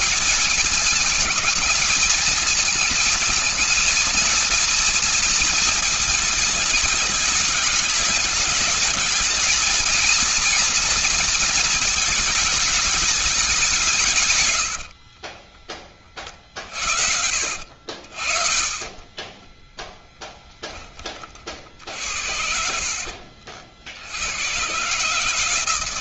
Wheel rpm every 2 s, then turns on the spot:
220, 220, 230, 210, 210, 220, 210, 50, 50, 20, 20, 60, 130.
14-16 18-20 22-24